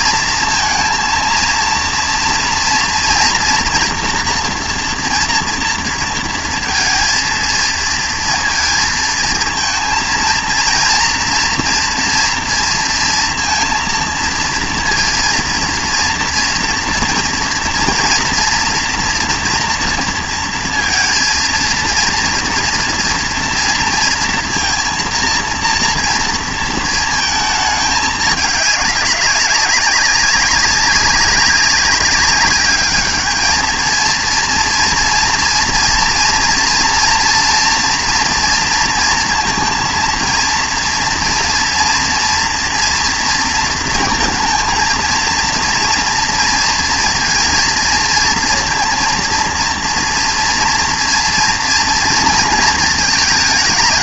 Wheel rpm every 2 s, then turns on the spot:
230, 230, 230, 230, 220, 230, 230, 230, 230, 230, 230, 230, 230, 230, 210, 200, 200, 230, 230, 230, 230, 230, 230, 230, 230, 240, 230.
none